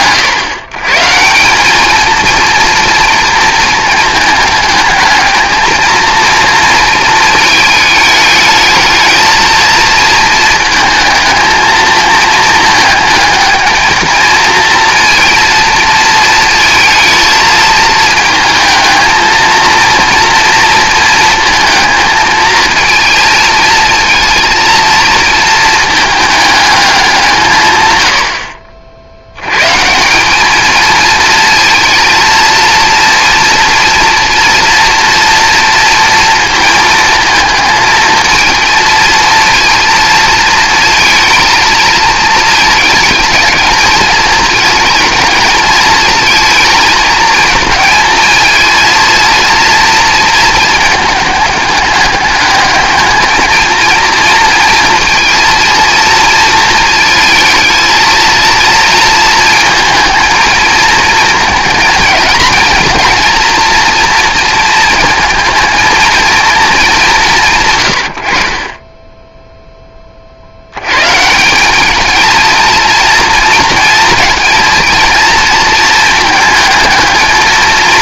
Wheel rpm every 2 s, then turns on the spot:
140, 230, 220, 230, 220, 230, 220, 230, 220, 220, 230, 220, 230, 210, 50, 210, 230, 240, 230, 220, 230, 220, 220, 230, 230, 220, 210, 230, 230, 230, 220, 230, 230, 220, 30, 90, 220, 230, 220.
none